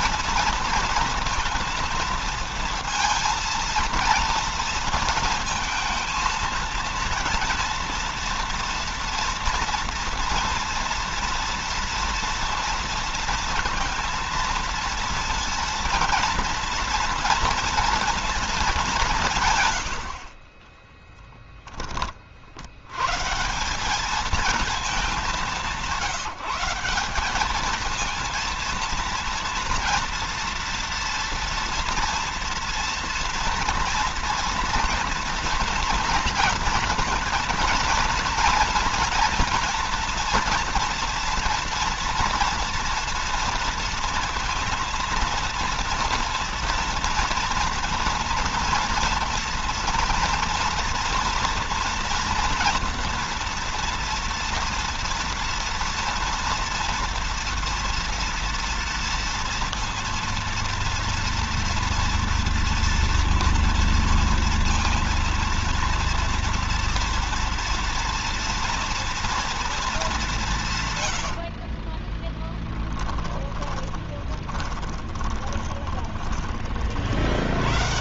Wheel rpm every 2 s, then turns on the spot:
230, 230, 230, 230, 230, 230, 230, 230, 230, 210, 20, 90, 210, 180, 230, 230, 230, 230, 230, 230, 240, 230, 230, 230, 230, 230, 230, 230, 240, 230, 230, 230, 230, 230, 230, 140, 10, 20, 40.
20-22 72-76